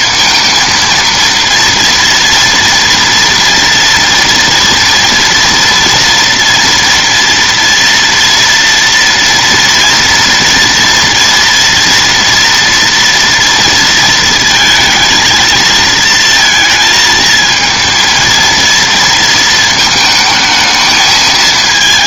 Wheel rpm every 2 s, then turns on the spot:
230, 230, 230, 230, 230, 230, 230, 230, 230, 230, 220.
none